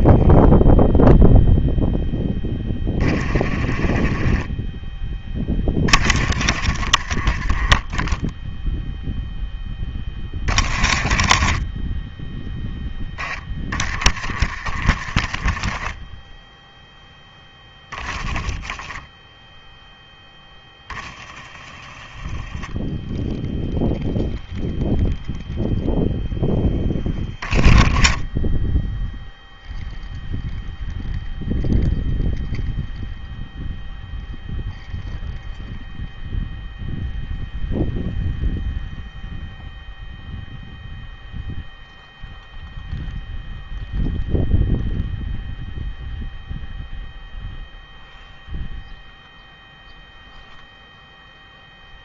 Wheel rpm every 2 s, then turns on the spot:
0, 20, 20, 50, 0, 20, 10, 50, 10, 10, 10, 0, 0, 10, 10, 0, 0, 0, 0, 0, 0, 0, 0, 0, 0, 0.
none